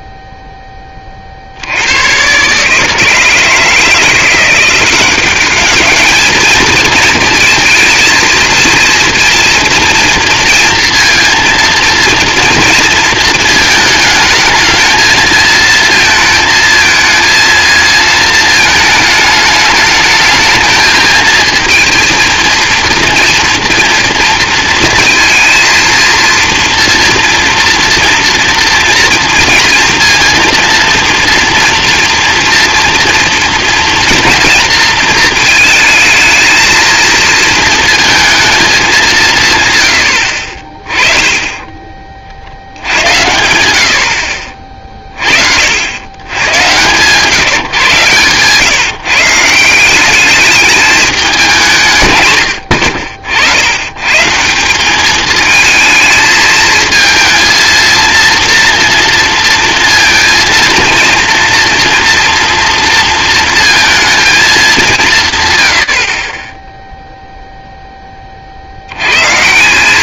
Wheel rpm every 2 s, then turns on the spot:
10, 140, 180, 220, 230, 230, 230, 220, 230, 220, 220, 230, 230, 230, 230, 230, 230, 230, 220, 210, 30, 70, 50, 110, 140, 210, 90, 160, 220, 230, 230, 240, 210, 20, 60.
none